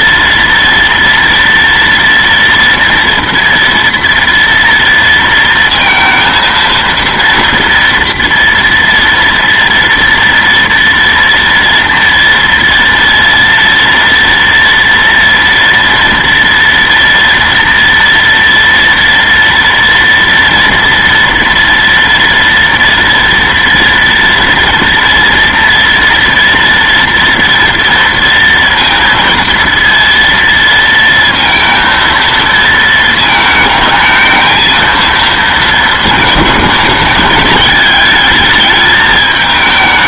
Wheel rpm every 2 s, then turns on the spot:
230, 230, 230, 230, 240, 230, 230, 230, 230, 230, 230, 240, 230, 230, 230, 230, 230, 220, 230, 220.
none